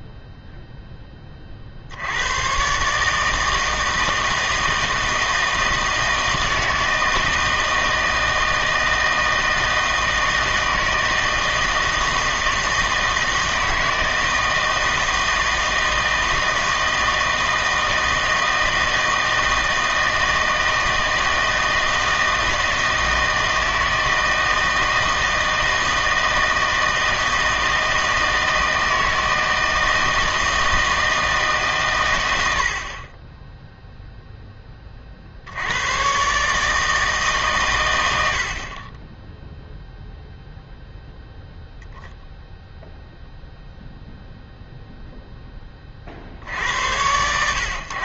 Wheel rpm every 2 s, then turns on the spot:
0, 130, 160, 160, 160, 160, 160, 160, 160, 160, 160, 160, 160, 160, 160, 160, 70, 20, 150, 50, 0, 0, 0, 80.
none